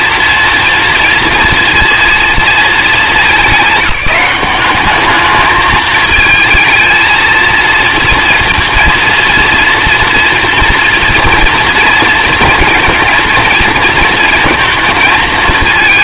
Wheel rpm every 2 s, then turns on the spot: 230, 220, 200, 220, 230, 230, 230, 230.
none